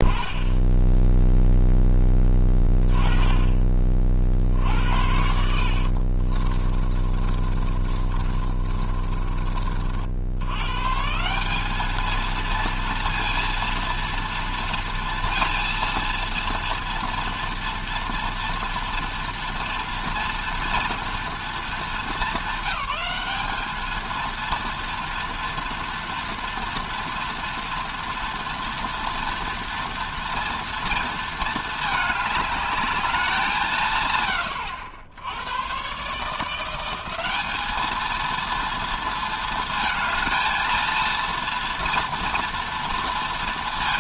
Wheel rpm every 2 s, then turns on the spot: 10, 20, 70, 30, 30, 130, 230, 230, 230, 230, 230, 200, 230, 240, 240, 230, 220, 100, 180, 220, 230, 230.
4-10